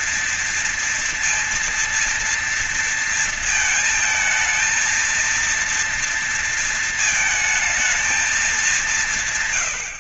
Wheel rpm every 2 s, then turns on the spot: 230, 230, 220, 230, 210.
none